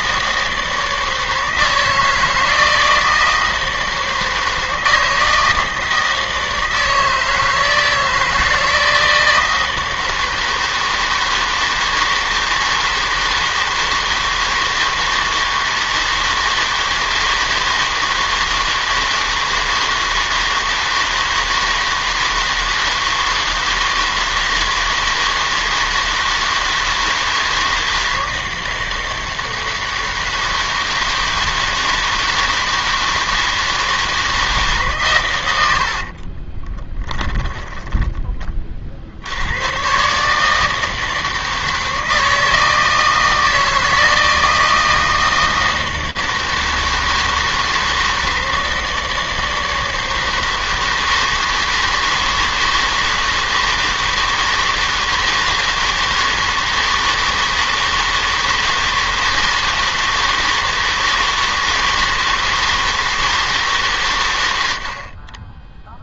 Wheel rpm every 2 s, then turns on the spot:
160, 160, 160, 160, 170, 160, 160, 160, 160, 160, 160, 160, 160, 160, 160, 160, 160, 140, 20, 40, 160, 160, 160, 160, 160, 160, 160, 160, 160, 160, 160, 160, 110.
36-38